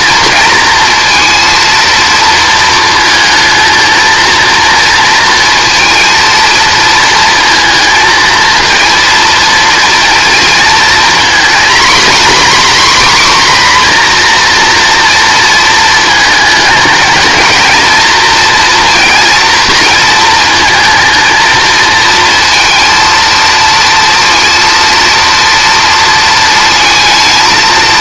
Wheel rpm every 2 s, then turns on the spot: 230, 230, 230, 230, 230, 230, 270, 240, 220, 230, 230, 230, 230, 220.
none